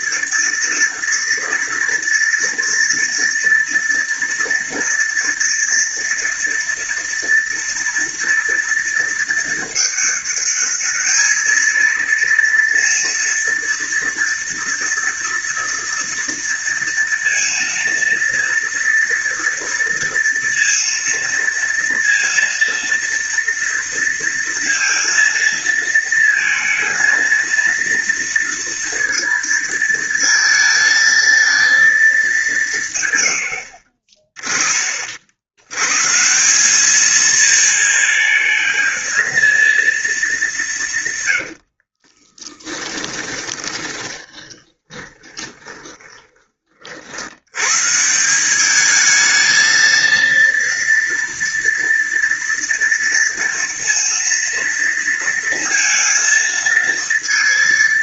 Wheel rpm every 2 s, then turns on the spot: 230, 230, 230, 230, 230, 220, 230, 230, 230, 230, 230, 230, 230, 230, 230, 230, 120, 50, 210, 220, 130, 20, 20, 70, 220, 230, 230, 230, 230.
40-46